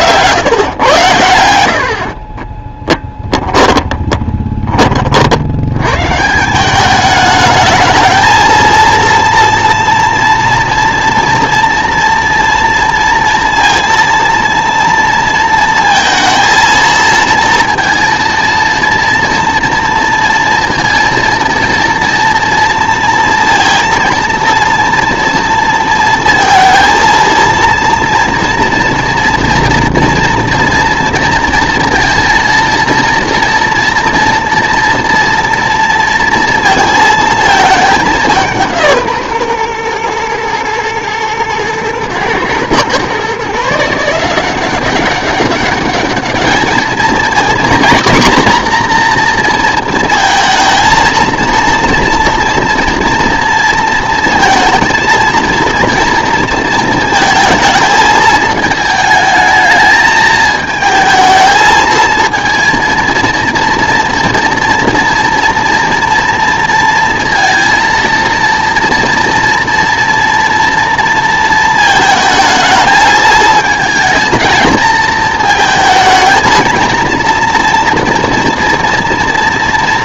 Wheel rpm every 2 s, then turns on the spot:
130, 10, 30, 200, 230, 230, 230, 230, 230, 230, 230, 230, 230, 230, 240, 230, 230, 230, 230, 170, 120, 130, 190, 220, 240, 230, 230, 230, 230, 220, 220, 230, 230, 230, 230, 230, 220, 220, 220, 230.
2-4